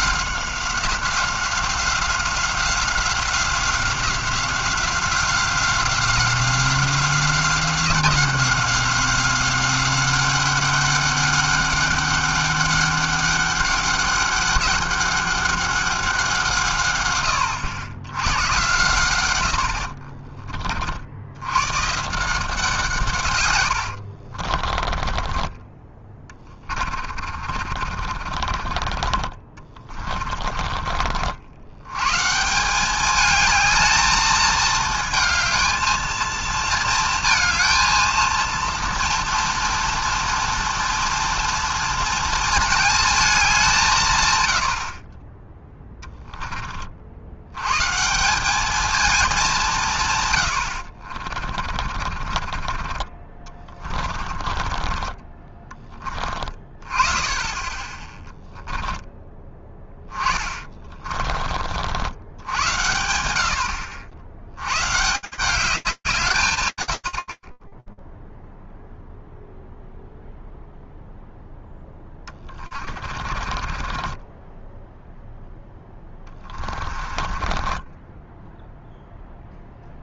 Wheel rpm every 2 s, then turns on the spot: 180, 190, 190, 180, 190, 190, 200, 190, 180, 90, 50, 150, 70, 20, 40, 30, 120, 220, 220, 230, 230, 230, 150, 10, 150, 140, 40, 30, 30, 10, 20, 70, 70, 170, 0, 0, 20, 20, 10, 10.
20-22 24-26 28-32 46-48 52-56 60-62 72-80